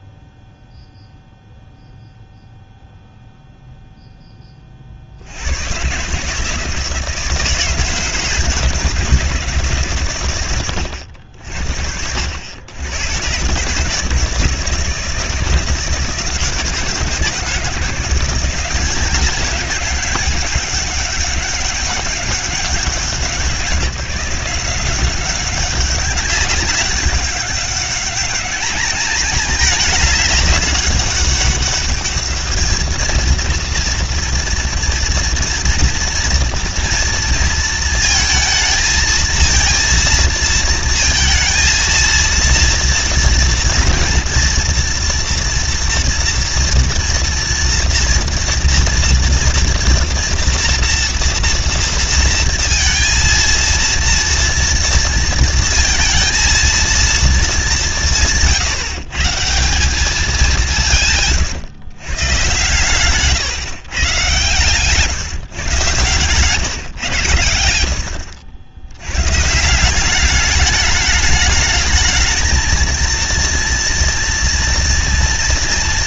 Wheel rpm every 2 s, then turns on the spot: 0, 0, 50, 160, 160, 80, 100, 160, 160, 190, 190, 180, 180, 200, 210, 200, 230, 230, 230, 230, 230, 230, 240, 240, 230, 230, 230, 230, 230, 150, 160, 140, 150, 120, 100, 210, 230, 230.
none